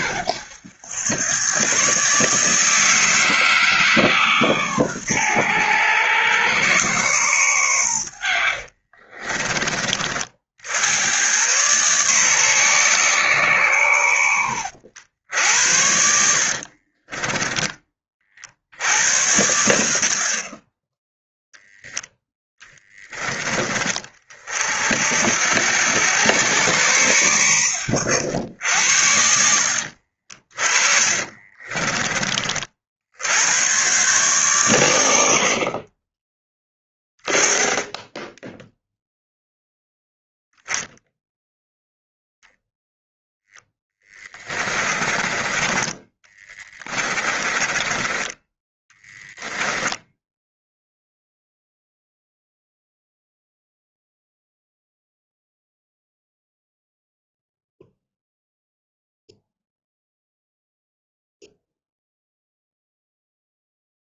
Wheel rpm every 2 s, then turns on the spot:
100, 160, 120, 120, 40, 70, 130, 80, 40, 80, 30, 20, 50, 100, 80, 40, 70, 110, 10, 0, 0, 0, 20, 30, 10, 0, 0, 0, 0, 0, 0, 0.
8-10 16-18 30-32 44-50